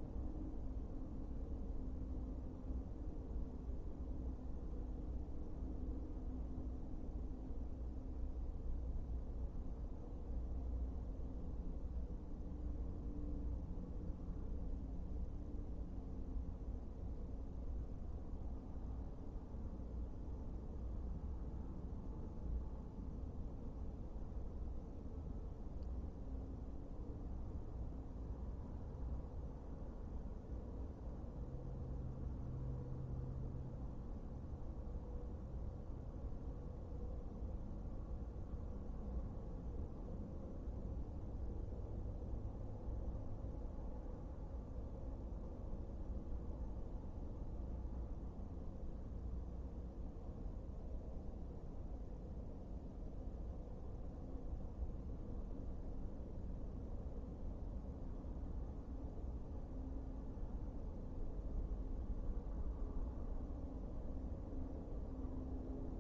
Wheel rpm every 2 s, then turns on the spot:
0, 0, 0, 0, 0, 0, 0, 0, 0, 0, 0, 0, 0, 0, 0, 0, 0, 0, 0, 0, 0, 0, 0, 0, 0, 0, 0, 0, 0, 0, 0, 0, 0.
none